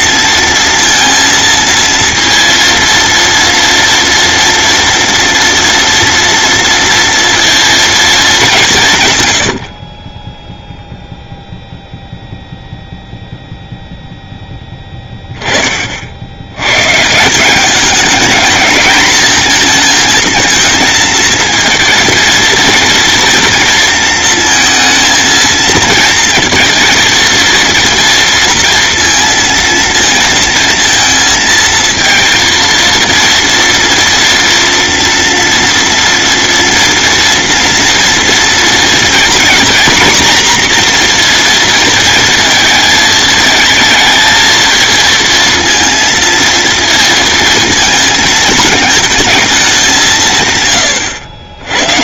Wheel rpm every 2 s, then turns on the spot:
230, 230, 230, 230, 150, 0, 0, 10, 130, 220, 230, 230, 230, 230, 230, 230, 230, 230, 230, 230, 240, 220, 230, 230, 220, 110.
none